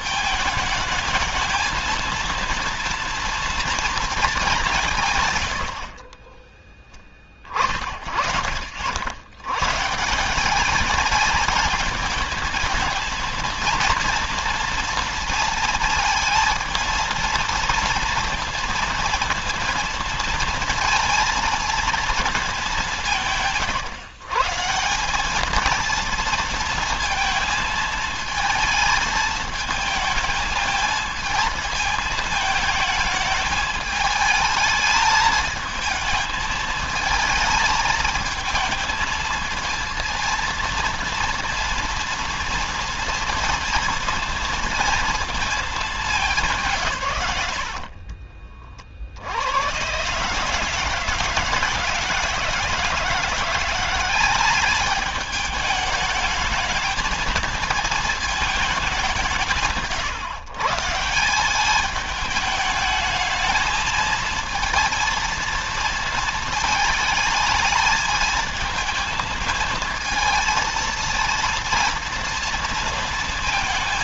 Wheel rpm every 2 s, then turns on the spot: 220, 230, 210, 10, 50, 190, 220, 230, 220, 230, 230, 210, 150, 230, 220, 220, 220, 220, 220, 230, 230, 230, 230, 160, 40, 140, 160, 190, 220, 210, 150, 210, 230, 220, 220, 230, 230.
none